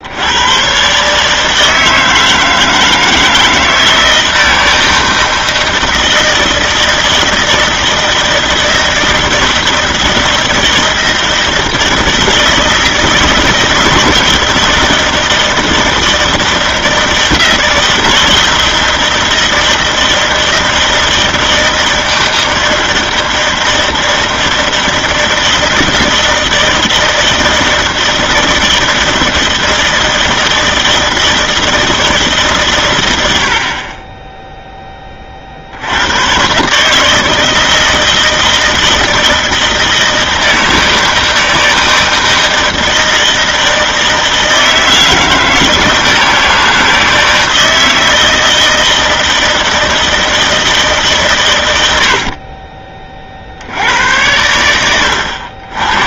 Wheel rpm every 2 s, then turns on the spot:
120, 160, 160, 160, 160, 160, 160, 160, 160, 160, 160, 160, 160, 160, 160, 160, 140, 10, 130, 160, 160, 160, 160, 160, 160, 160, 40, 100.
none